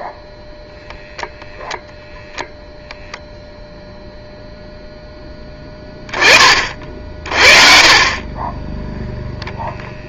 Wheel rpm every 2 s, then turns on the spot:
0, 0, 0, 50, 10.
none